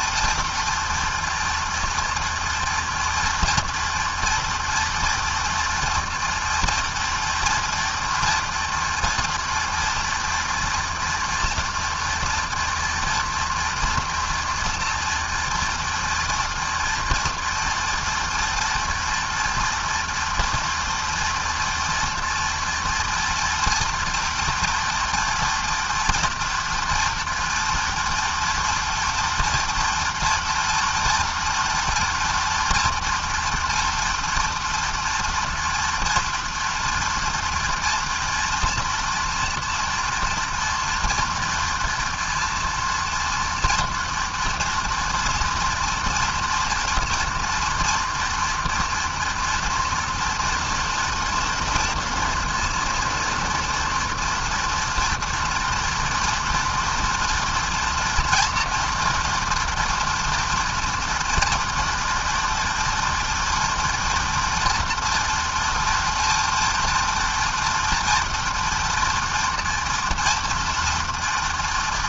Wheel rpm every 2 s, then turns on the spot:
230, 230, 240, 230, 230, 230, 240, 240, 230, 230, 230, 230, 240, 240, 240, 240, 230, 230, 230, 230, 230, 230, 230, 230, 230, 230, 230, 230, 230, 230, 230, 230, 230, 230, 230, 230.
none